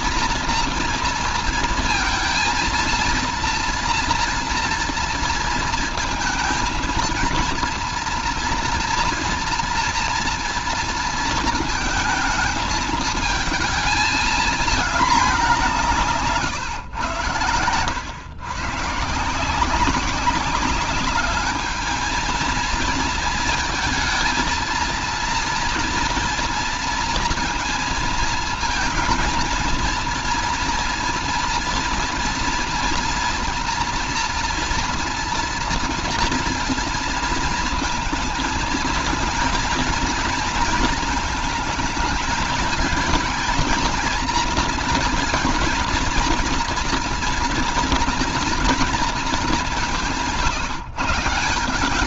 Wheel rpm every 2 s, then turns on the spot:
240, 230, 240, 230, 230, 230, 220, 220, 150, 120, 190, 220, 230, 230, 230, 230, 230, 230, 230, 220, 230, 220, 230, 230, 230, 170.
none